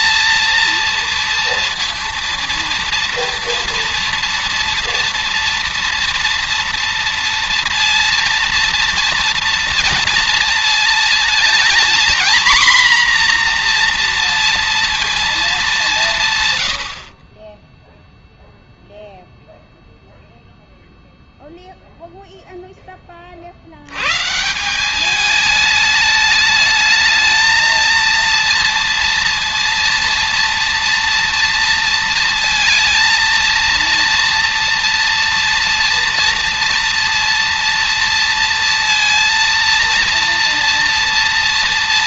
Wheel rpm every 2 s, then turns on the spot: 230, 230, 230, 230, 230, 220, 240, 230, 60, 0, 0, 20, 190, 220, 230, 230, 230, 230, 230, 230, 230.
none